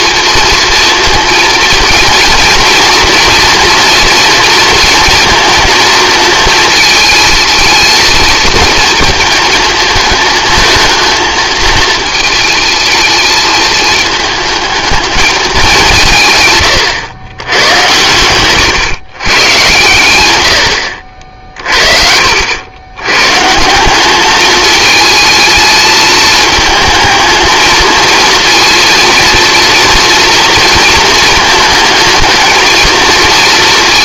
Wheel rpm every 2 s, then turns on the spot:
230, 230, 230, 230, 230, 220, 220, 220, 120, 120, 90, 90, 210, 220, 230, 230, 220.
20-22